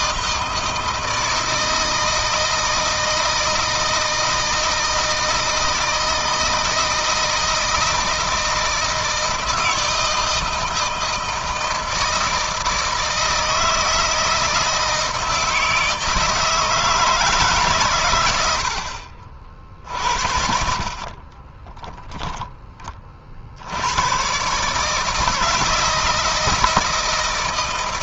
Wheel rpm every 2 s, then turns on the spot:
160, 160, 160, 160, 160, 160, 160, 160, 160, 70, 50, 20, 150, 160.
none